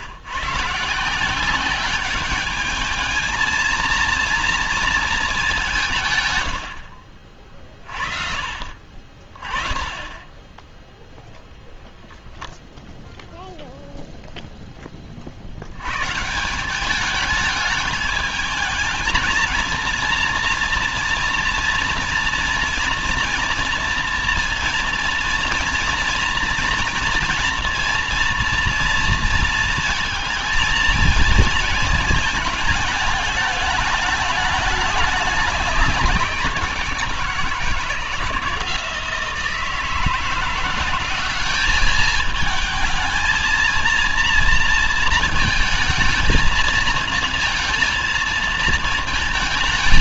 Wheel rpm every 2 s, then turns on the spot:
140, 210, 230, 100, 50, 10, 0, 0, 170, 220, 230, 230, 230, 230, 230, 220, 220, 210, 170, 160, 180, 220, 230, 220, 230.
none